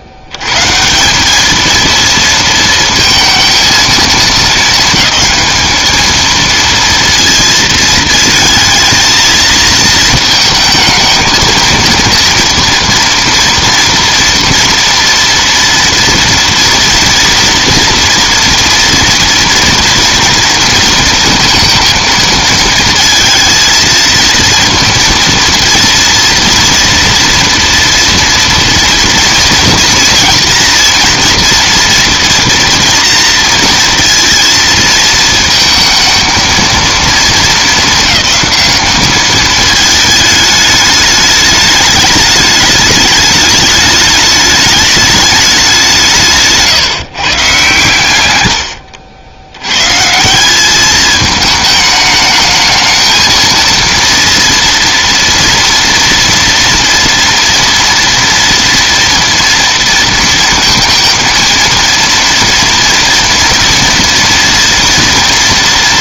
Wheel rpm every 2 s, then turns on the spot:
100, 220, 210, 230, 220, 220, 230, 230, 230, 230, 230, 230, 230, 230, 230, 230, 230, 230, 230, 210, 210, 210, 210, 150, 80, 210, 220, 230, 230, 230, 230, 230, 230.
none